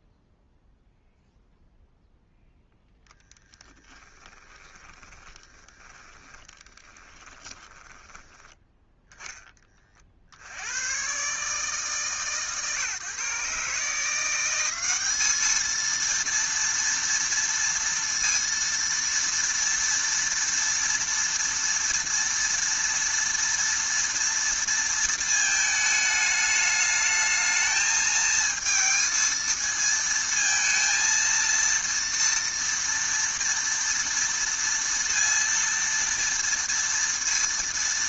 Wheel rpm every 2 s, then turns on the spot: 0, 0, 20, 20, 10, 90, 150, 190, 230, 230, 230, 230, 230, 210, 230, 230, 230, 230, 230.
4-8